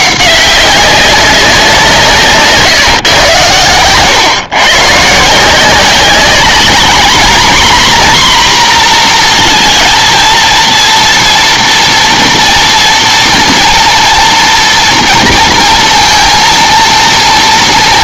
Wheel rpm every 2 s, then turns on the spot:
200, 150, 130, 210, 250, 240, 230, 230, 230.
none